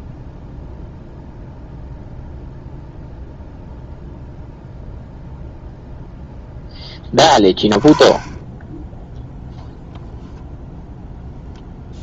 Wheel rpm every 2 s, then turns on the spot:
0, 0, 0, 10, 10, 10.
none